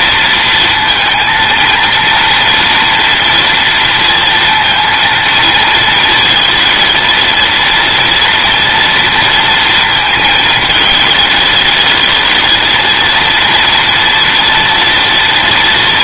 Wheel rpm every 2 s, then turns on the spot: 230, 230, 230, 230, 230, 220, 220, 240.
none